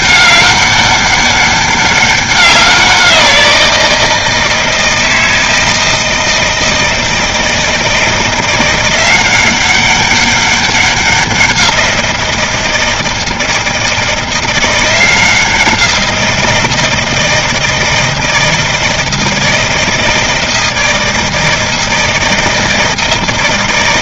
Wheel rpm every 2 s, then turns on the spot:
200, 180, 160, 160, 180, 190, 160, 170, 160, 160, 160, 160.
none